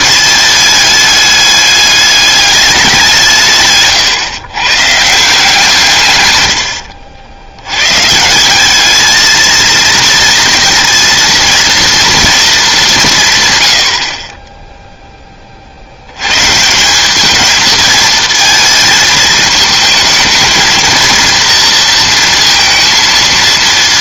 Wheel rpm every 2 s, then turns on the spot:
220, 200, 130, 100, 200, 230, 220, 10, 180, 220, 230, 230.
6-8